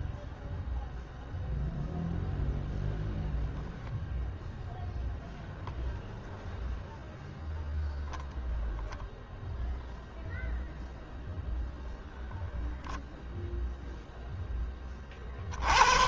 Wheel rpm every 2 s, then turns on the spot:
0, 0, 0, 0, 0, 0, 40, 140.
none